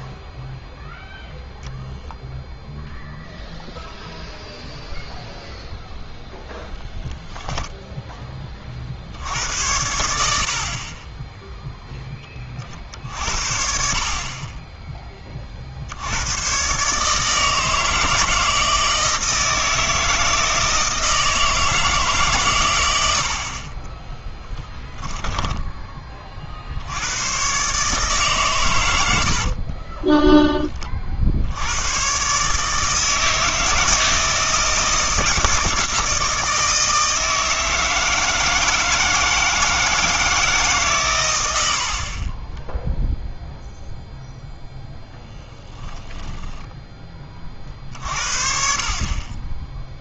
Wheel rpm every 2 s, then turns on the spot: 0, 0, 0, 10, 50, 50, 40, 10, 130, 160, 160, 110, 10, 60, 110, 20, 150, 160, 160, 160, 150, 10, 0, 10, 40.
6-8 24-26 42-44